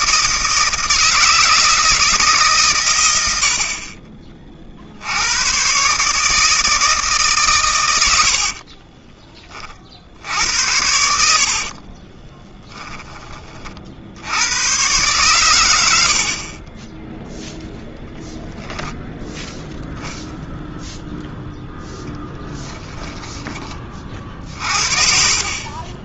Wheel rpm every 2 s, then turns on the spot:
160, 110, 70, 160, 30, 80, 20, 120, 10, 0, 0, 10, 50.
8-10 22-24